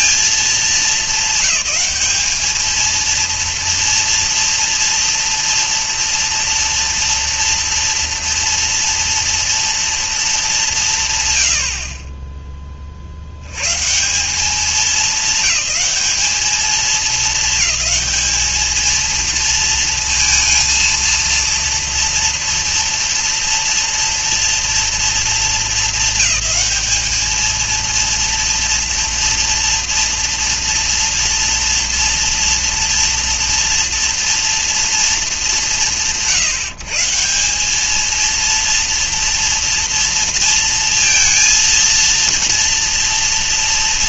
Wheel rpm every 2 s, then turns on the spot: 210, 230, 230, 230, 230, 180, 10, 200, 210, 220, 230, 240, 230, 210, 230, 240, 230, 230, 160, 230, 230, 230.
none